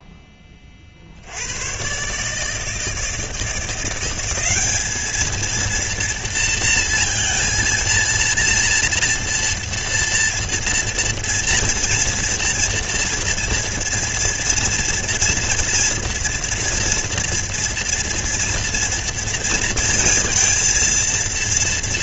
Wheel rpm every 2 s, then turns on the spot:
10, 140, 190, 230, 230, 230, 230, 230, 230, 230, 230.
none